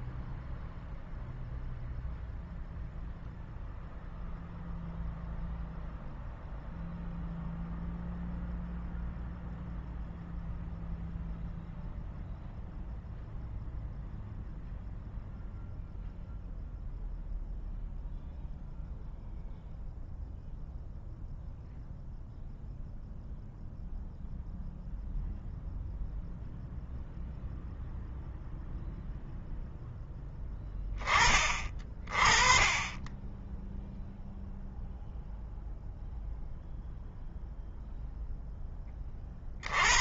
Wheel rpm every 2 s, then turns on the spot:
0, 0, 0, 0, 0, 0, 0, 0, 0, 0, 0, 0, 0, 0, 0, 20, 20, 0, 0, 30.
none